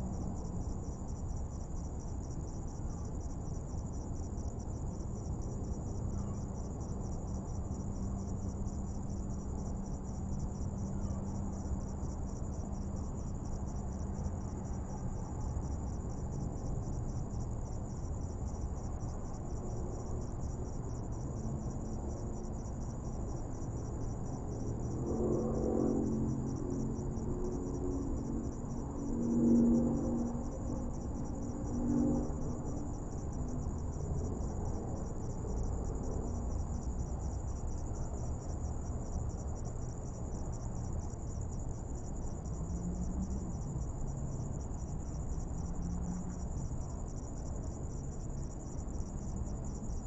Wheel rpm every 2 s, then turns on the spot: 0, 0, 0, 0, 0, 0, 0, 0, 0, 0, 0, 0, 0, 0, 0, 0, 0, 0, 0, 0, 0, 0, 0, 0, 0.
none